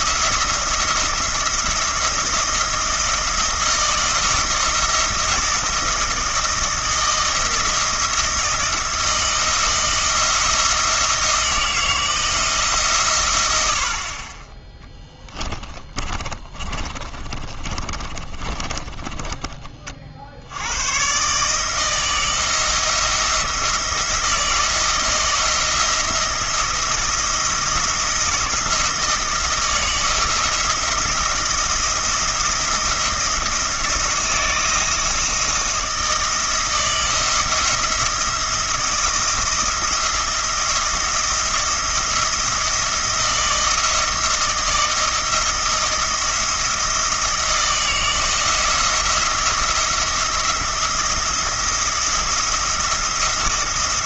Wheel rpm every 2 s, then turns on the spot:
170, 170, 170, 170, 160, 170, 140, 10, 30, 20, 110, 170, 160, 170, 160, 170, 170, 170, 160, 170, 170, 170, 160, 160, 160, 170, 170.
16-20